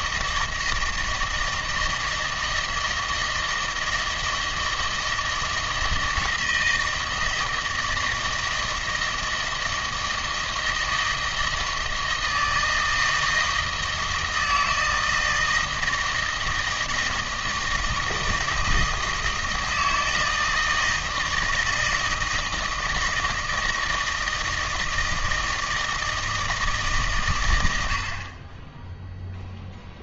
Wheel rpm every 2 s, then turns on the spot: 160, 160, 160, 160, 160, 160, 160, 160, 160, 160, 160, 160, 160, 160, 20.
none